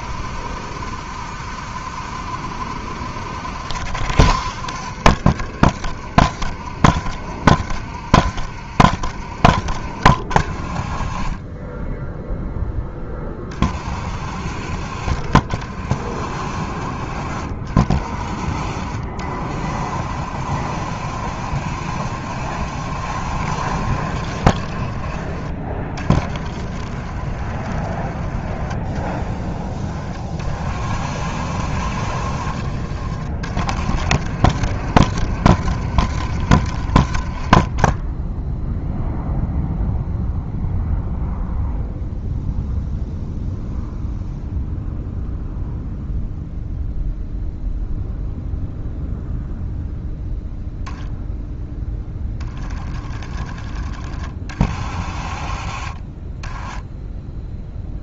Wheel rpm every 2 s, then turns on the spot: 70, 70, 60, 70, 70, 30, 10, 50, 40, 50, 50, 60, 50, 40, 30, 40, 40, 60, 60, 0, 0, 0, 0, 0, 0, 0, 20, 40, 10.
28-30 52-54